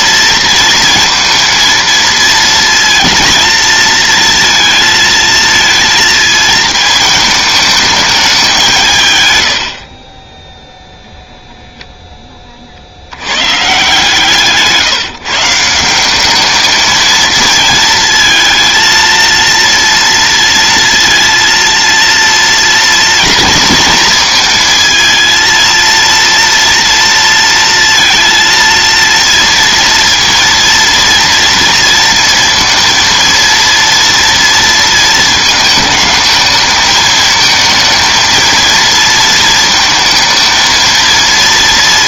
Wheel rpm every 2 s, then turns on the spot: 230, 230, 230, 220, 150, 10, 70, 150, 220, 230, 230, 230, 220, 230, 230, 230, 230, 230, 220, 230, 230.
none